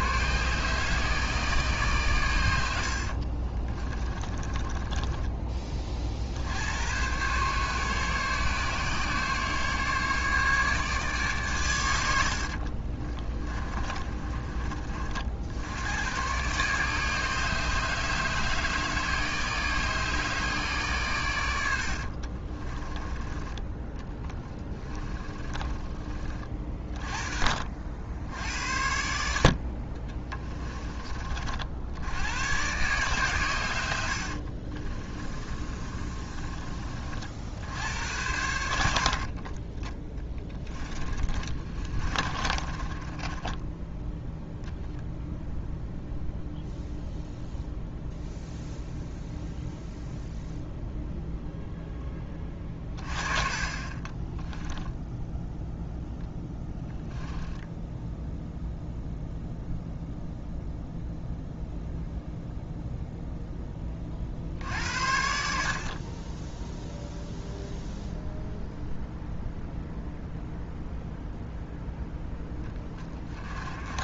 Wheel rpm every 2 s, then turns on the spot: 150, 80, 20, 90, 140, 150, 50, 30, 140, 150, 140, 30, 20, 30, 70, 20, 130, 30, 30, 70, 10, 30, 0, 0, 0, 0, 30, 10, 10, 0, 0, 0, 70, 0, 0, 0, 10.
4-6 12-14 22-26 34-36 40-44 54-56 72-74